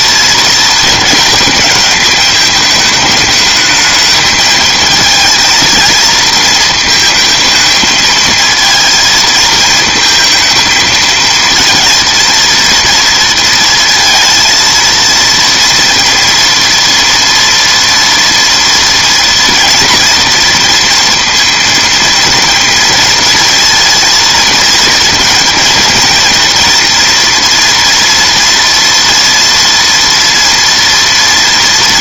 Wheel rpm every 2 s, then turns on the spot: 230, 220, 220, 220, 230, 220, 230, 230, 230, 240, 230, 230, 220, 230, 230, 240.
none